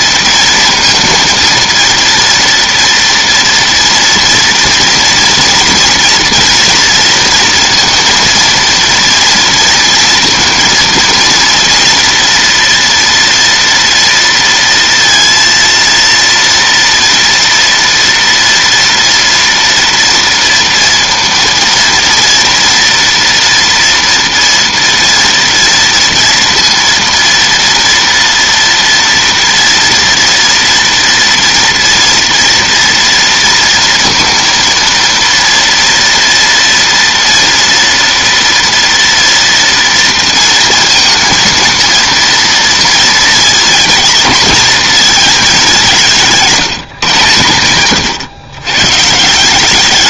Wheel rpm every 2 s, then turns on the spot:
230, 230, 230, 230, 230, 230, 230, 230, 230, 230, 230, 230, 230, 230, 230, 240, 230, 230, 230, 240, 230, 230, 220, 140, 130.
none